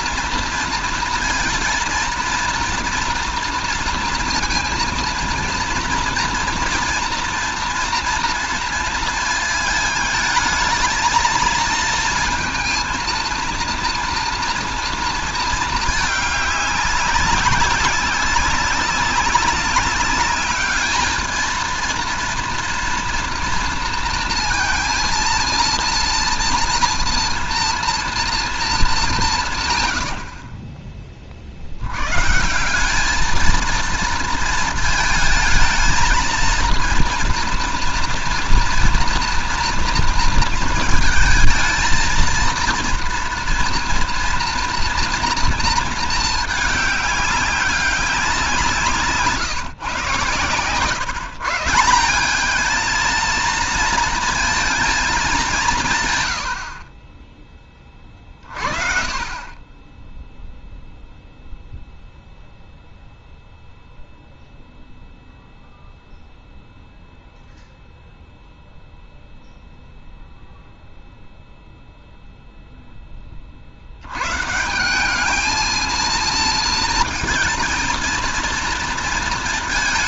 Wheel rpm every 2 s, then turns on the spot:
230, 230, 230, 230, 230, 220, 230, 240, 210, 190, 210, 230, 230, 230, 220, 40, 160, 230, 230, 230, 230, 230, 230, 210, 180, 120, 200, 230, 80, 30, 0, 0, 0, 0, 0, 0, 0, 140, 230, 230.
none